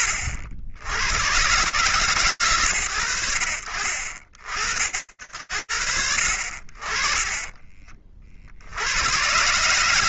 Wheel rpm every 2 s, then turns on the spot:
70, 120, 50, 40, 120.
none